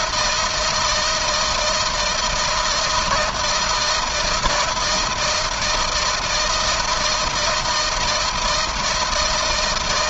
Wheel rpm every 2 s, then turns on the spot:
160, 160, 170, 160, 160.
none